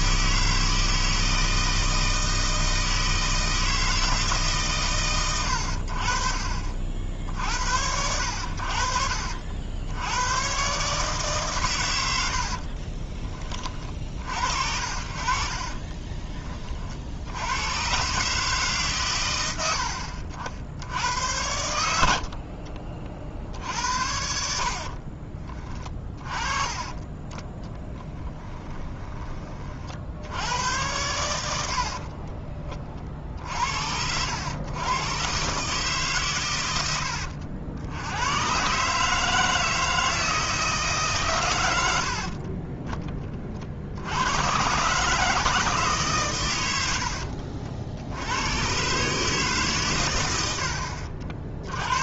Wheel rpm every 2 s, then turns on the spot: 160, 160, 130, 50, 60, 130, 50, 60, 40, 140, 80, 50, 50, 20, 20, 90, 30, 100, 110, 120, 160, 30, 130, 100, 110, 90.
12-14 22-26 28-30 42-44